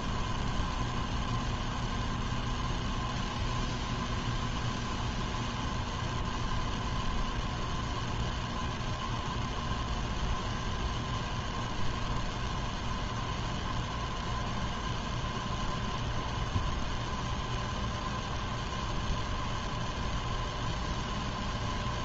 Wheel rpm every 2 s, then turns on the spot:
0, 0, 0, 0, 0, 0, 0, 0, 0, 0, 0.
none